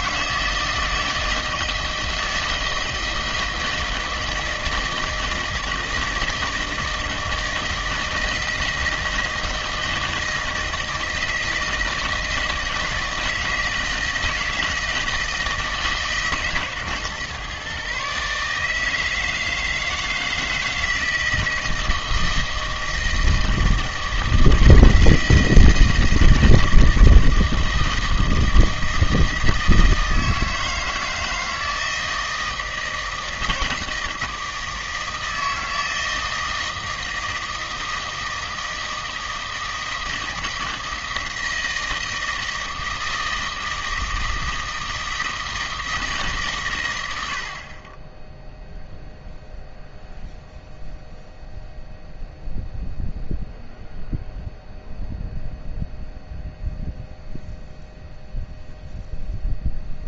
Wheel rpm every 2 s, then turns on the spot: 160, 160, 160, 160, 160, 160, 160, 160, 140, 150, 160, 160, 160, 160, 160, 160, 160, 160, 160, 160, 160, 160, 160, 130, 0, 0, 0, 0, 0, 0.
none